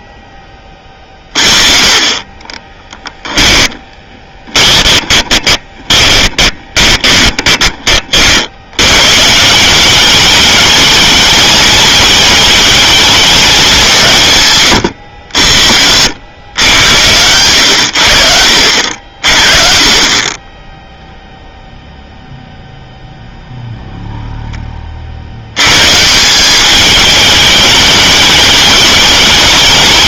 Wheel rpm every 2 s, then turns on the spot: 30, 10, 20, 20, 100, 210, 210, 120, 110, 60, 10, 0, 30, 200, 210.
2-8